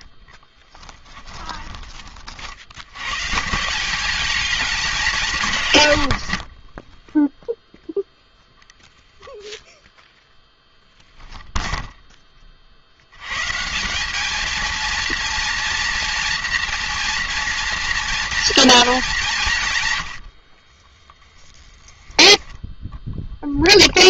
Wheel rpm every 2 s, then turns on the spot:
30, 190, 90, 0, 0, 0, 180, 230, 230, 110, 10, 10.
4-6 18-24